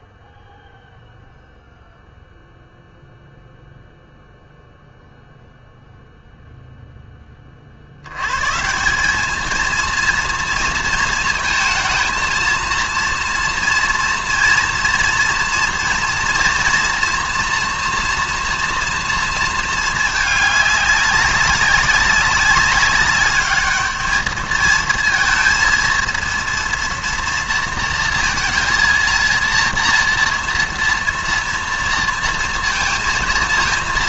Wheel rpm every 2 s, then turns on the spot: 0, 0, 0, 0, 130, 230, 230, 230, 230, 240, 210, 200, 220, 230, 230, 230, 230.
none